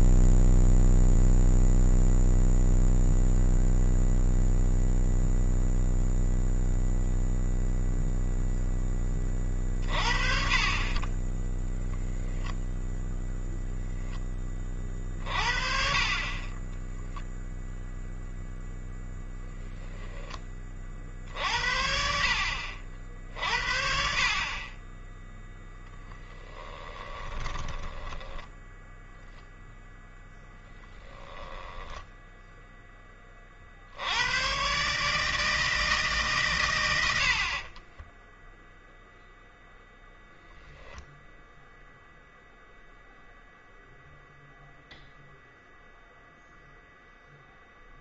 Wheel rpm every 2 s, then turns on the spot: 0, 0, 0, 0, 0, 40, 10, 30, 10, 0, 40, 70, 20, 20, 10, 20, 10, 140, 110, 0, 0, 0, 0, 0.
26-32